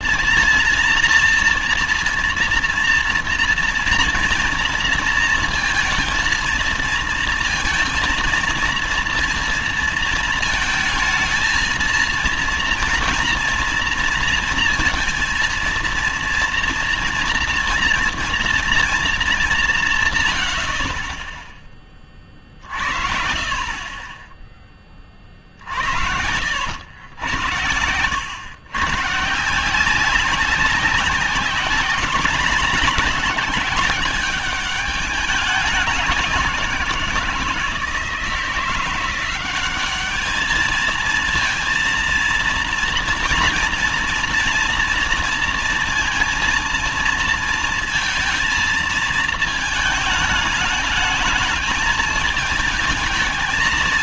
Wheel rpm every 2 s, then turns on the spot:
230, 230, 230, 230, 230, 220, 230, 230, 230, 230, 60, 40, 20, 70, 110, 200, 200, 200, 180, 170, 210, 230, 230, 230, 230, 210, 220.
none